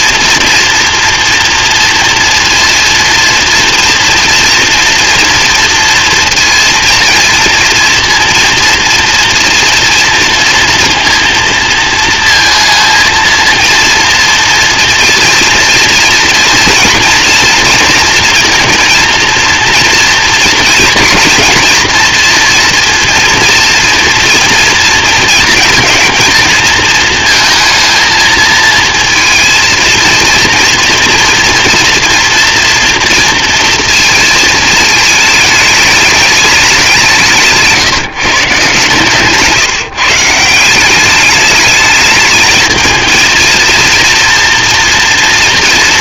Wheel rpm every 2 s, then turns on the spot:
230, 230, 230, 230, 230, 230, 230, 230, 230, 230, 230, 230, 230, 220, 220, 230, 240, 220, 190, 140, 180, 220, 230.
none